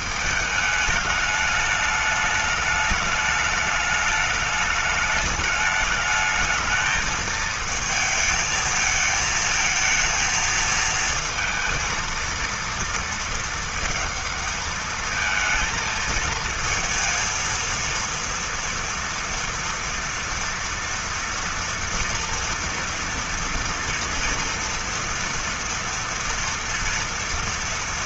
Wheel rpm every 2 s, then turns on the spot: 210, 210, 210, 220, 220, 220, 230, 220, 230, 230, 240, 230, 230, 230.
none